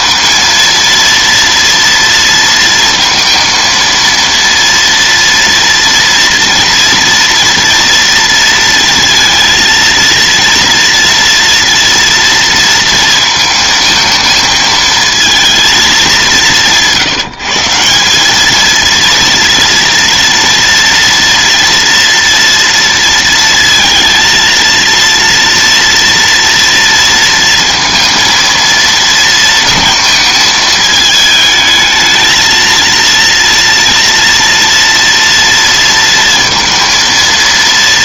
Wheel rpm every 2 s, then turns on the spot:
230, 230, 230, 230, 230, 230, 230, 220, 170, 230, 230, 230, 230, 230, 230, 220, 230, 230, 230.
none